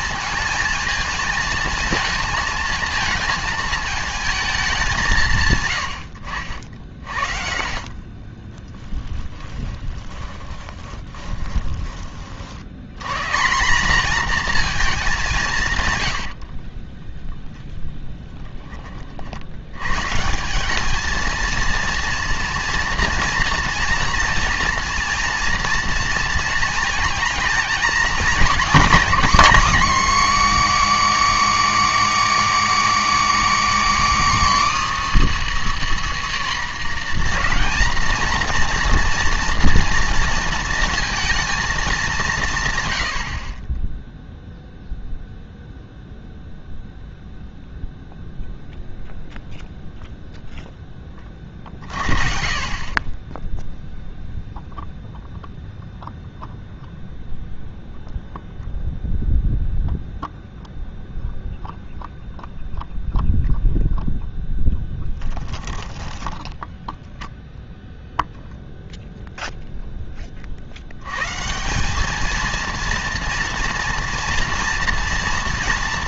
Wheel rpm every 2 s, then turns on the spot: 220, 220, 210, 60, 20, 20, 70, 230, 40, 20, 200, 230, 230, 230, 250, 300, 310, 320, 260, 230, 230, 130, 0, 0, 0, 0, 40, 0, 0, 0, 0, 0, 0, 0, 0, 60, 230, 240.
8-12 16-18